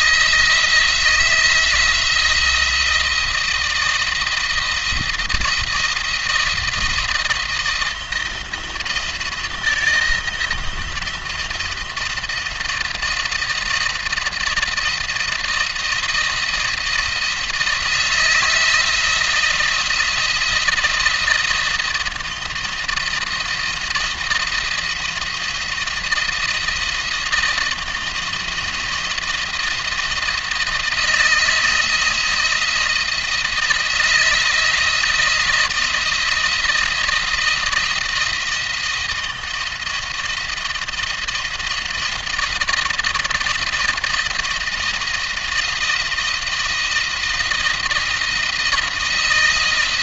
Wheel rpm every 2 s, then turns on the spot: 160, 170, 170, 170, 160, 170, 170, 170, 170, 170, 170, 170, 170, 170, 170, 170, 170, 170, 170, 170, 170, 170, 170, 170, 170.
none